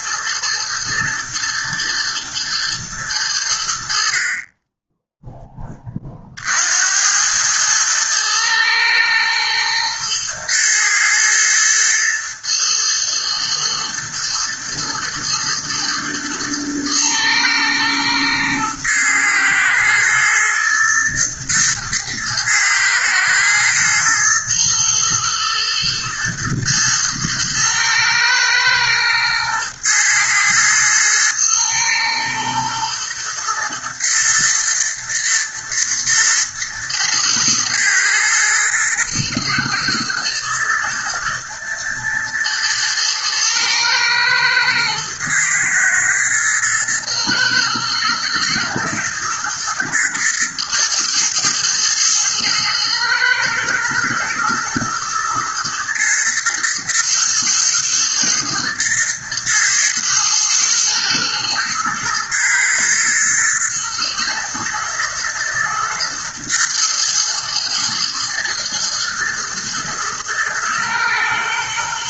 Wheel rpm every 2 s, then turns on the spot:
110, 110, 10, 80, 110, 120, 110, 110, 110, 110, 120, 110, 120, 120, 110, 110, 120, 110, 110, 110, 120, 110, 110, 110, 110, 120, 120, 110, 120, 120, 110, 110, 120, 110, 110, 110.
none